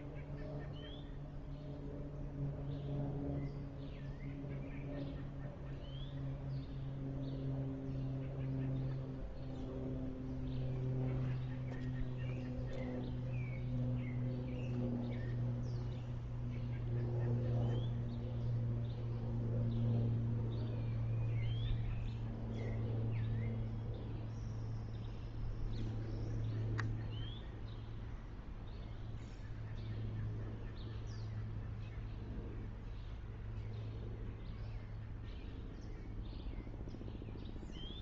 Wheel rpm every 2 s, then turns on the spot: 0, 0, 0, 0, 0, 0, 0, 0, 0, 0, 0, 0, 0, 0, 0, 0, 0, 0, 0.
none